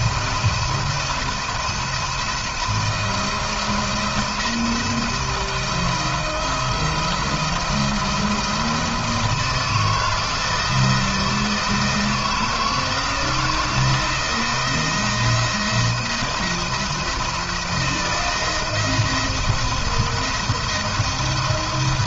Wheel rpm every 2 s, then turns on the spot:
170, 170, 170, 170, 160, 170, 160, 160, 170, 170, 170.
none